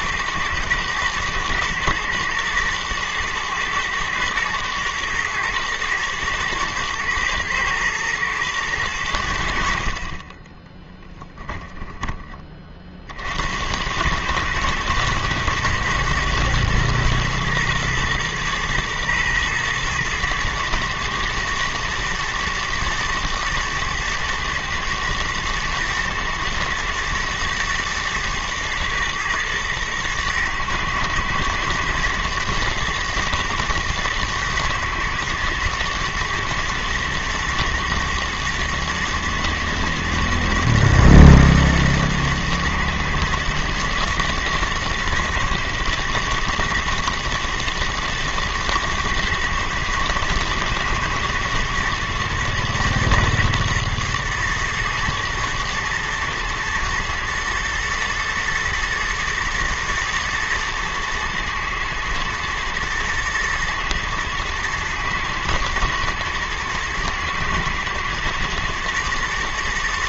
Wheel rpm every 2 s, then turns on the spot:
110, 110, 110, 120, 110, 20, 50, 110, 120, 120, 110, 110, 120, 110, 120, 110, 110, 110, 110, 120, 120, 120, 110, 110, 120, 110, 120, 110, 110, 110, 110, 110, 110, 120, 110.
10-12